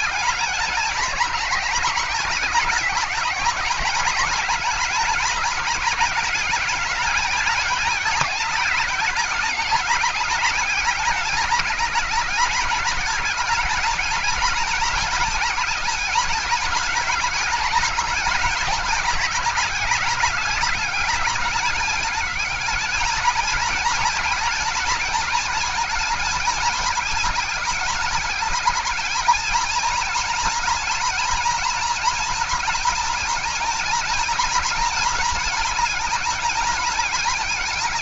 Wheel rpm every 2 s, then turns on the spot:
220, 210, 210, 220, 210, 210, 210, 220, 220, 210, 210, 220, 220, 210, 220, 230, 230, 220, 220.
none